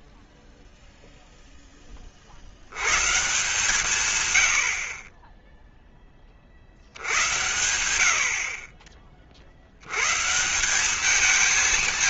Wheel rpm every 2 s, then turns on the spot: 0, 120, 40, 90, 40, 210.
none